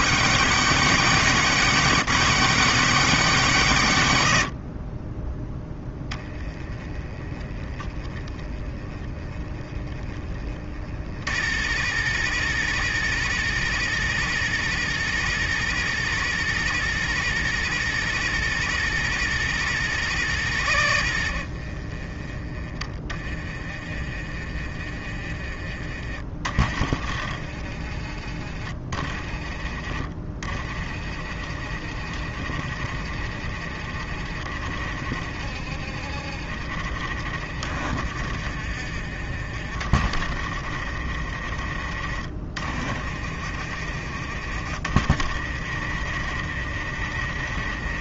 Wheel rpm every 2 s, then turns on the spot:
140, 150, 40, 10, 10, 30, 60, 60, 60, 60, 50, 20, 20, 30, 20, 30, 40, 40, 40, 30, 40, 30, 40, 40.
none